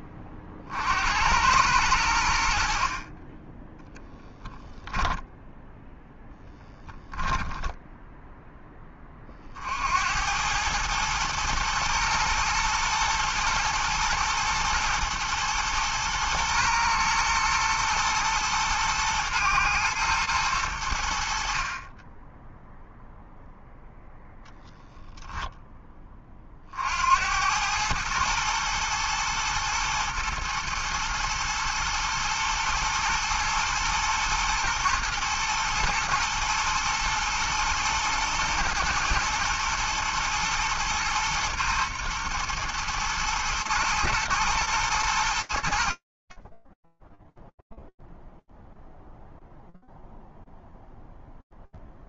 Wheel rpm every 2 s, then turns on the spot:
50, 60, 10, 10, 10, 110, 120, 110, 120, 110, 110, 0, 0, 50, 110, 110, 120, 110, 110, 120, 120, 120, 110, 20, 0, 0.
4-8